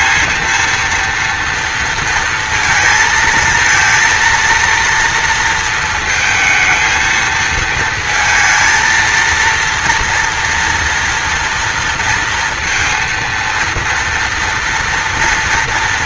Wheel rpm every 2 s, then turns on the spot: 230, 230, 230, 220, 230, 230, 230, 230.
none